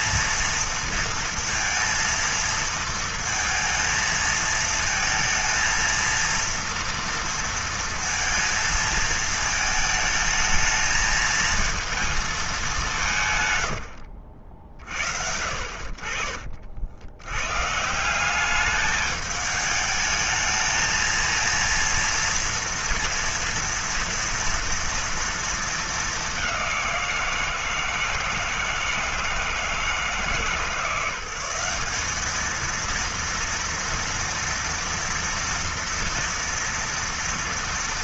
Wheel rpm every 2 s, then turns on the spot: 230, 230, 220, 230, 220, 220, 210, 70, 50, 200, 220, 230, 230, 190, 160, 160, 220, 230, 230.
none